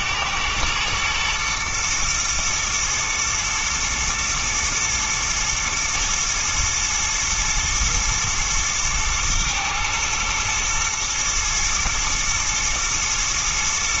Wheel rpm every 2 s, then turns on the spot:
110, 120, 120, 110, 110, 110, 110.
none